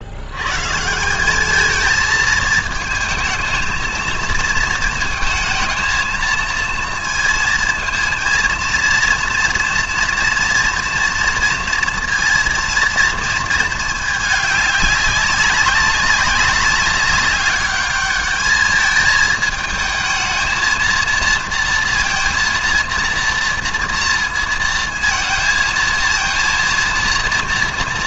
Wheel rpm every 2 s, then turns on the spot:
150, 220, 220, 230, 230, 230, 230, 200, 190, 210, 220, 230, 230, 230.
none